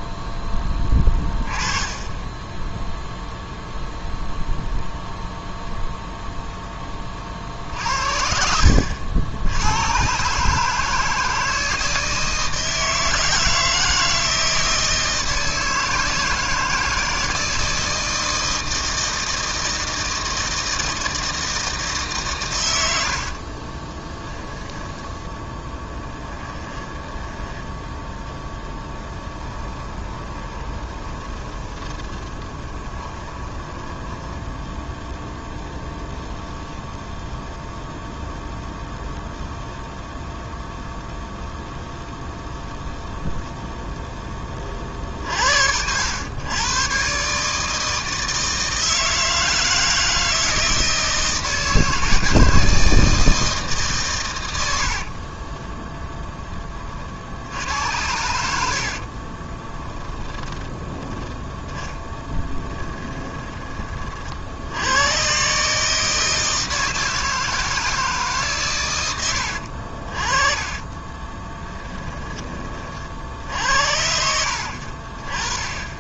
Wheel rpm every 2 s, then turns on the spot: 10, 10, 0, 10, 70, 150, 160, 160, 160, 160, 160, 100, 10, 10, 10, 20, 20, 0, 0, 0, 0, 0, 30, 110, 160, 160, 160, 80, 30, 70, 10, 10, 80, 160, 130, 30, 30, 60.
26-28 30-34 54-56 58-60 62-64 70-72